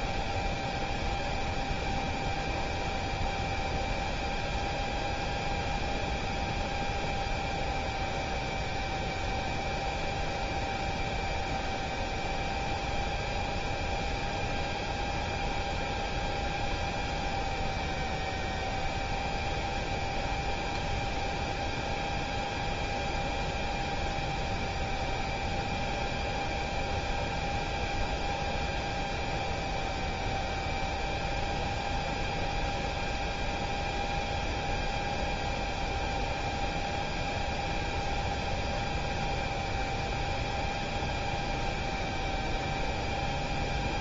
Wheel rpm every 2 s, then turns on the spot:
0, 0, 0, 0, 0, 0, 0, 0, 0, 0, 0, 0, 0, 0, 0, 0, 0, 0, 0, 0, 0, 0.
none